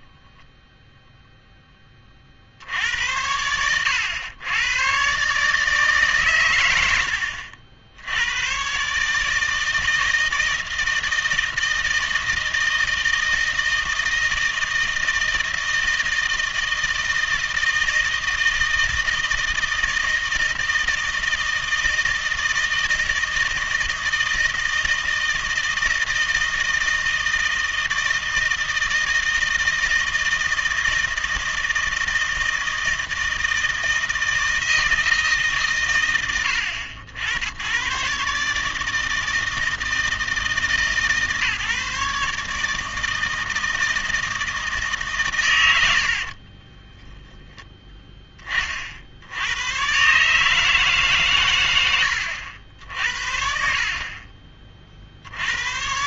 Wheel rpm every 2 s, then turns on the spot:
0, 80, 100, 110, 130, 160, 160, 160, 160, 160, 160, 160, 160, 160, 160, 160, 160, 160, 80, 160, 150, 160, 150, 10, 50, 150, 70, 50.
46-48 52-54